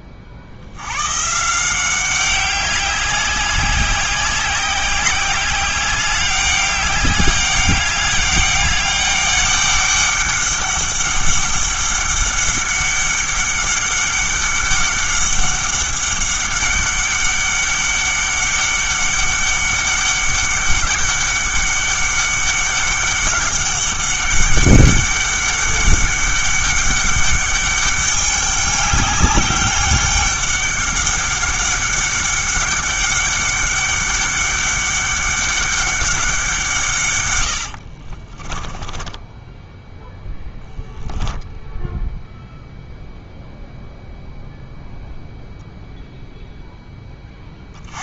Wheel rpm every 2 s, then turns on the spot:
90, 190, 190, 200, 200, 200, 200, 200, 200, 190, 200, 200, 200, 200, 200, 200, 200, 200, 170, 30, 10, 0, 0, 0.
38-40